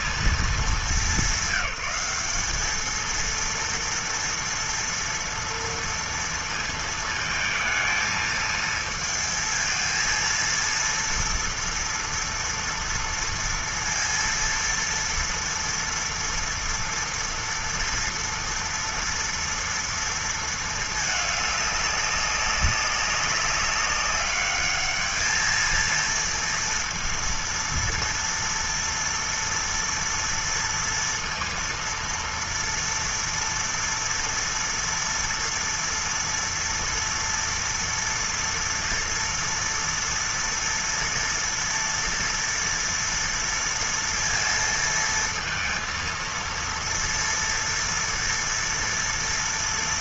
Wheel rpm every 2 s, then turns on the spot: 210, 200, 230, 230, 220, 230, 230, 230, 230, 230, 220, 200, 210, 230, 230, 230, 230, 230, 230, 230, 240, 240, 230, 230, 230.
none